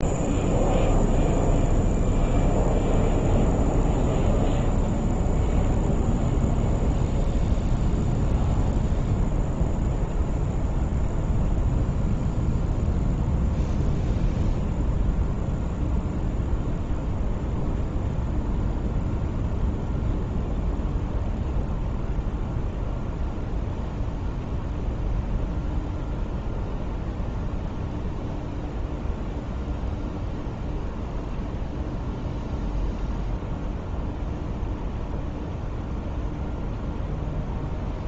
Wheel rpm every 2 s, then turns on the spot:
0, 0, 0, 0, 0, 0, 0, 0, 0, 0, 0, 0, 0, 0, 0, 0, 0, 0, 0.
none